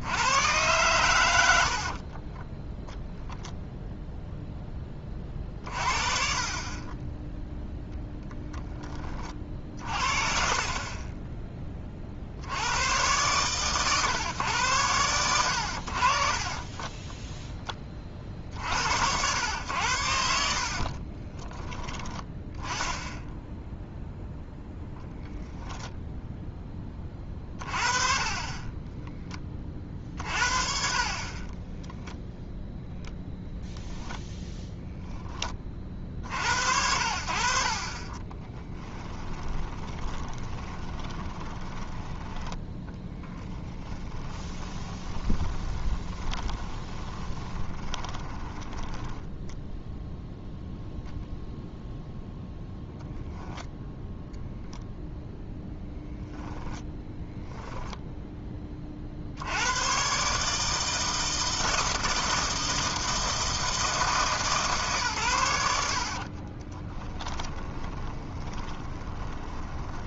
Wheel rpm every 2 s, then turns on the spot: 110, 0, 20, 30, 20, 30, 100, 110, 20, 70, 50, 10, 10, 20, 20, 40, 0, 0, 60, 10, 20, 10, 20, 20, 10, 0, 0, 0, 10, 40, 160, 160, 140, 20, 20.
16-18 20-24 38-48 56-58 66-70